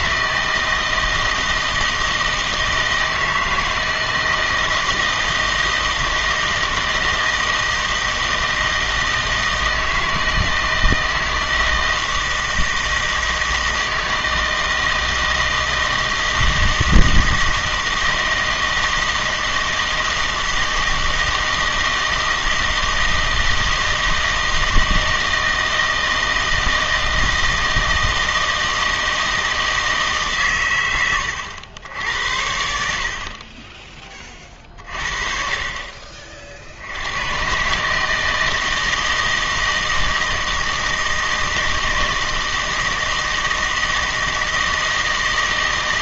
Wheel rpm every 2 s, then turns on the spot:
160, 160, 160, 160, 160, 160, 160, 160, 160, 160, 160, 160, 160, 160, 160, 120, 70, 40, 60, 160, 160, 160, 160.
none